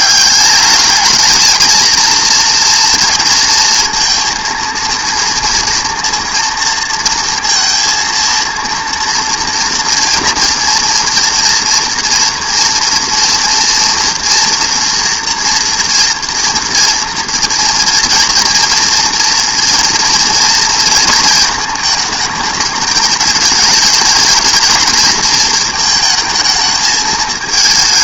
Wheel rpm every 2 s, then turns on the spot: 210, 230, 230, 230, 230, 230, 230, 230, 230, 230, 230, 210, 230, 220.
none